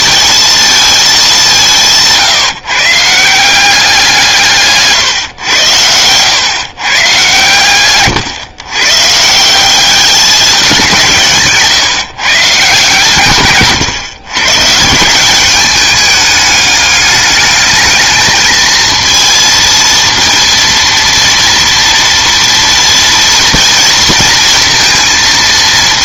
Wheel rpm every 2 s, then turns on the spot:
220, 150, 150, 120, 130, 190, 150, 150, 210, 220, 230, 230, 230.
none